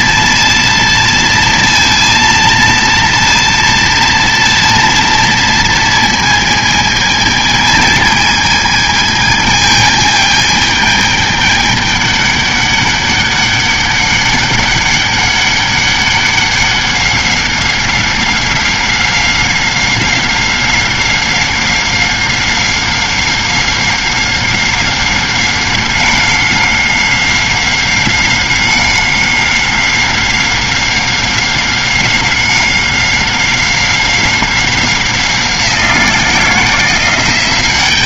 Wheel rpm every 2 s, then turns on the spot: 230, 230, 230, 220, 220, 220, 200, 200, 200, 190, 190, 190, 190, 190, 190, 190, 190, 190, 170.
none